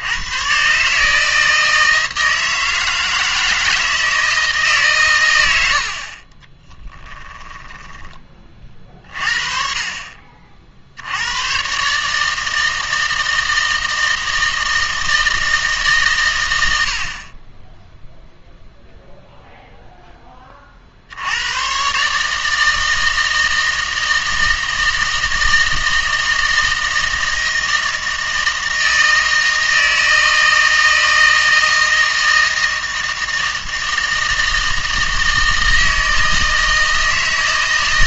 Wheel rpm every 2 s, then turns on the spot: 140, 160, 150, 20, 30, 60, 160, 160, 80, 0, 40, 160, 160, 160, 160, 160, 160, 160, 160.
6-8